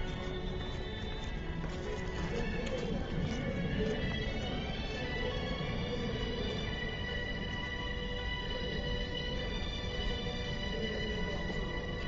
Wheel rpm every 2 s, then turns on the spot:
0, 0, 0, 0, 0, 0.
none